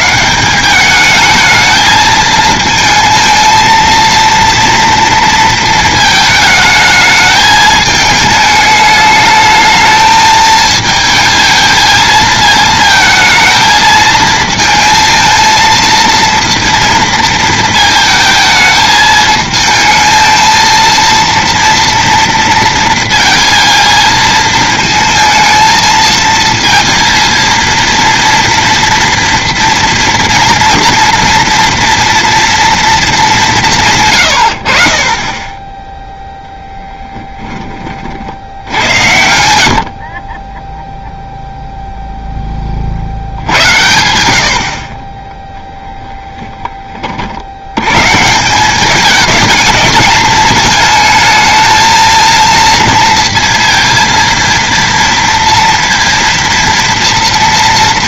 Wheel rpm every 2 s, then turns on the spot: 200, 220, 230, 220, 210, 220, 220, 230, 230, 220, 230, 230, 230, 230, 230, 230, 230, 60, 10, 70, 0, 40, 50, 30, 200, 220, 230, 230, 230.
none